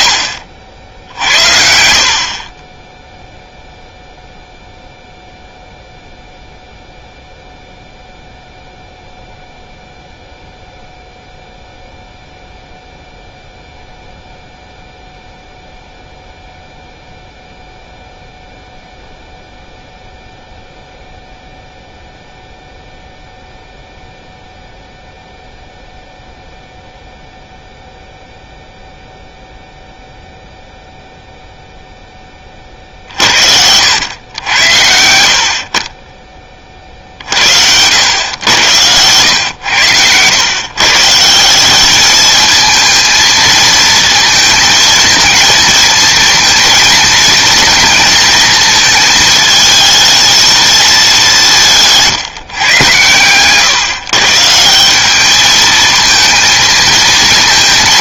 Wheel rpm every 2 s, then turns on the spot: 80, 10, 0, 0, 0, 0, 0, 0, 0, 0, 0, 0, 0, 0, 0, 0, 40, 80, 40, 100, 130, 220, 220, 230, 220, 220, 120, 170, 230.
none